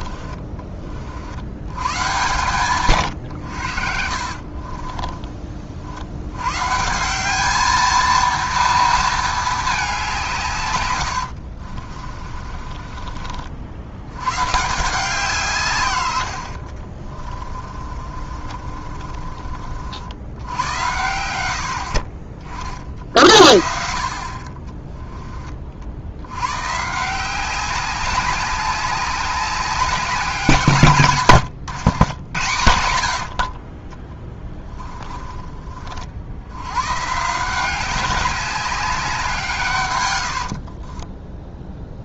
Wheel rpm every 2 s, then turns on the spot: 50, 130, 30, 170, 230, 110, 40, 140, 40, 40, 100, 60, 20, 150, 200, 150, 80, 20, 120, 190, 30.
2-6 10-14 16-20 32-36 40-42